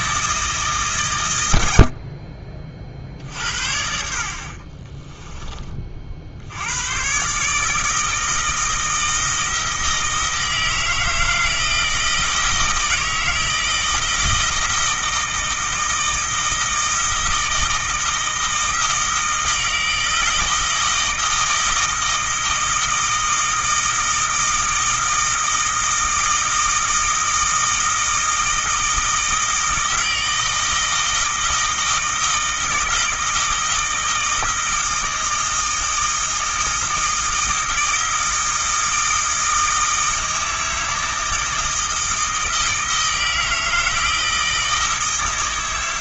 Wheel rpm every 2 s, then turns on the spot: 150, 40, 40, 90, 160, 160, 160, 160, 160, 160, 160, 160, 160, 160, 160, 160, 160, 160, 160, 160, 160, 160, 160.
4-6